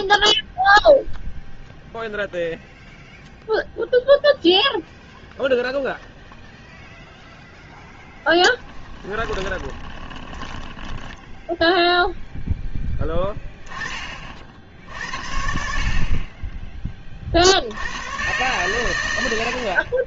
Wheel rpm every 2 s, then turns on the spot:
0, 0, 0, 0, 10, 10, 10, 60, 20, 120.
8-12